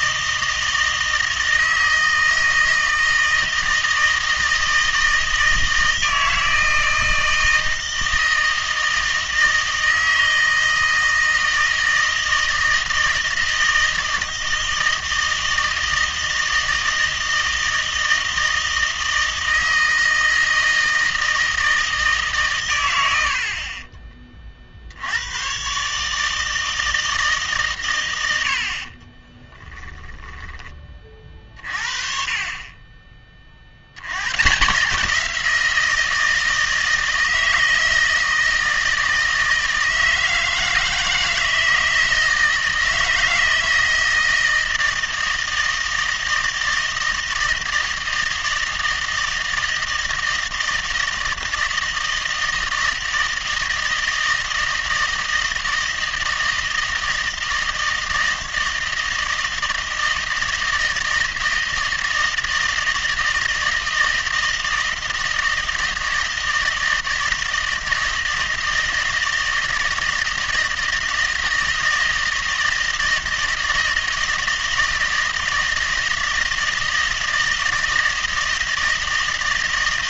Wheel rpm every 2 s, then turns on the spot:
160, 160, 160, 160, 160, 160, 160, 160, 160, 160, 160, 110, 40, 160, 60, 20, 30, 150, 160, 160, 160, 160, 160, 160, 160, 160, 160, 160, 160, 160, 160, 160, 160, 160, 160, 160, 160, 160, 160, 160.
none